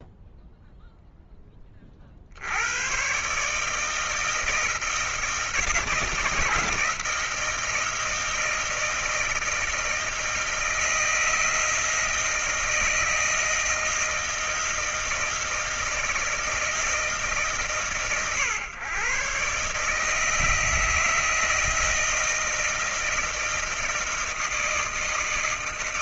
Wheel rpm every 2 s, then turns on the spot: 0, 90, 160, 160, 160, 160, 160, 160, 160, 120, 160, 160, 160.
none